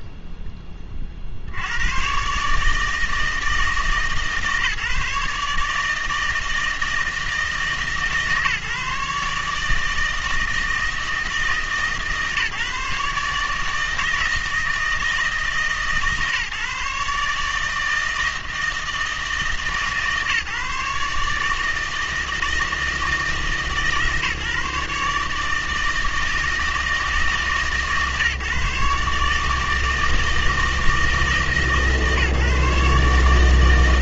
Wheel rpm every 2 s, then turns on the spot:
20, 150, 150, 160, 150, 160, 150, 160, 150, 160, 150, 160, 140, 160, 140, 160, 150.
none